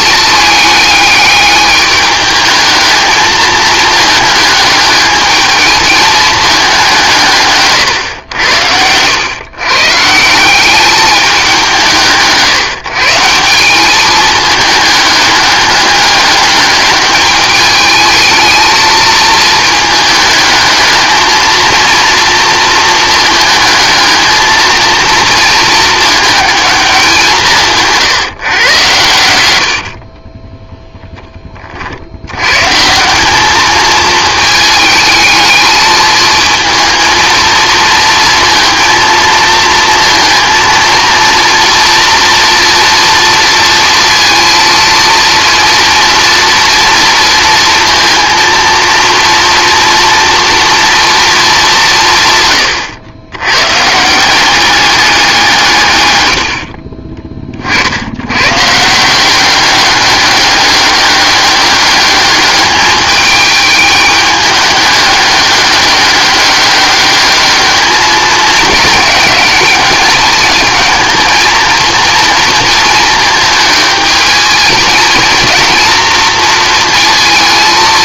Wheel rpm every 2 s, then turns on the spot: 210, 220, 210, 190, 100, 200, 150, 210, 210, 220, 210, 220, 230, 200, 120, 0, 160, 220, 230, 230, 230, 230, 230, 230, 230, 230, 110, 190, 40, 160, 200, 210, 210, 200, 220, 220, 230, 220, 230.
56-58